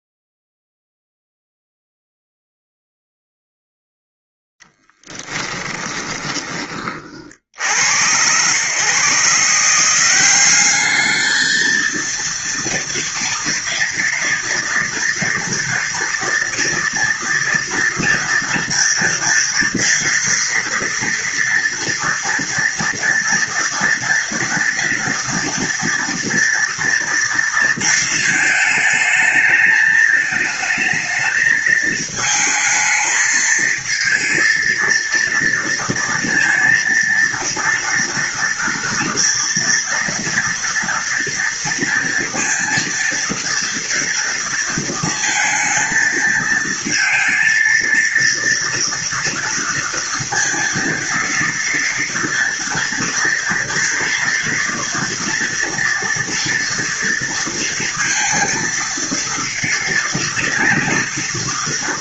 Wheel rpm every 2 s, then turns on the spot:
0, 0, 10, 20, 120, 200, 230, 230, 230, 230, 230, 230, 230, 230, 220, 220, 220, 230, 230, 230, 230, 230, 230, 230, 230, 230, 230, 240, 230, 230, 230.
4-6